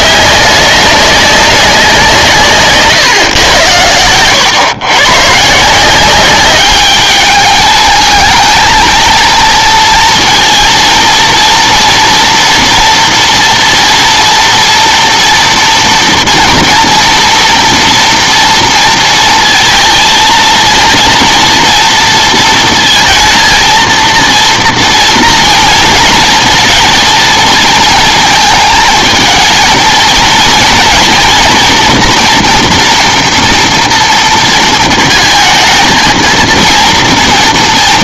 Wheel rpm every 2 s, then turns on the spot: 200, 140, 120, 200, 220, 230, 230, 230, 230, 230, 230, 230, 230, 230, 220, 230, 230, 220, 230.
none